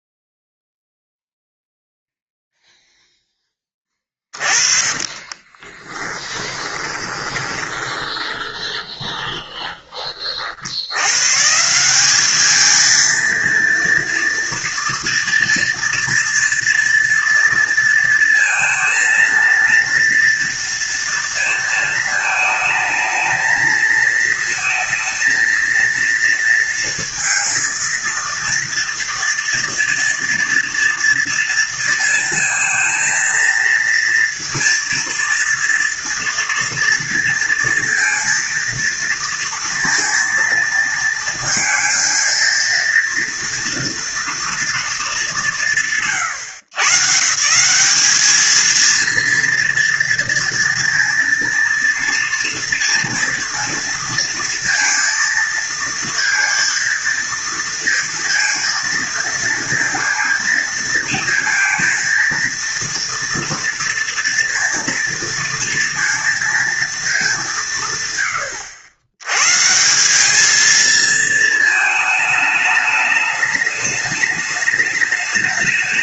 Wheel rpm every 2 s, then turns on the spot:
0, 0, 20, 20, 20, 130, 230, 230, 230, 230, 230, 220, 230, 230, 230, 230, 230, 230, 230, 230, 230, 230, 150, 150, 230, 230, 230, 230, 230, 230, 230, 230, 230, 210, 110, 220, 210, 210.
4-10